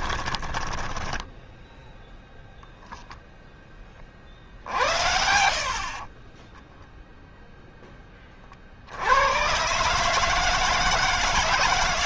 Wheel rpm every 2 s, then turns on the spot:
20, 0, 50, 20, 50, 160.
0-2 6-8